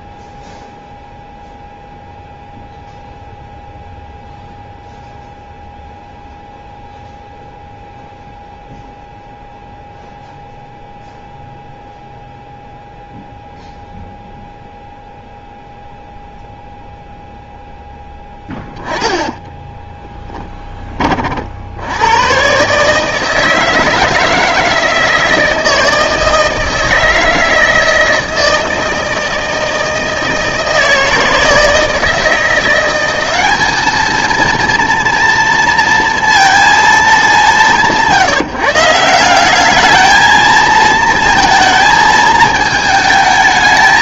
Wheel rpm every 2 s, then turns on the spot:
0, 0, 0, 0, 0, 0, 0, 0, 0, 10, 20, 130, 160, 160, 160, 160, 170, 230, 230, 160, 220, 220.
18-20